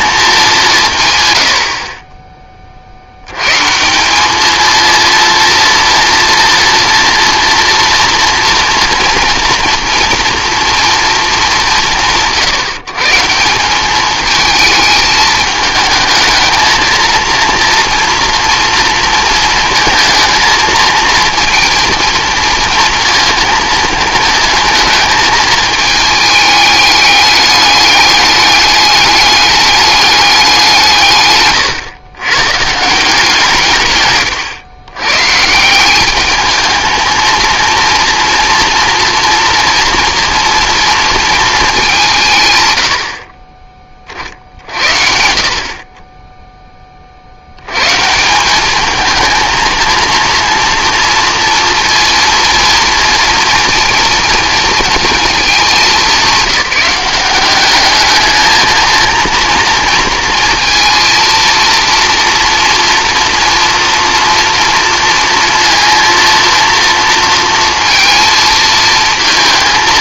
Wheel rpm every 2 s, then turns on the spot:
170, 40, 220, 230, 230, 240, 150, 220, 230, 230, 230, 230, 220, 210, 210, 170, 150, 120, 220, 230, 230, 110, 60, 20, 200, 230, 230, 230, 190, 220, 230, 230, 230, 230, 230.
none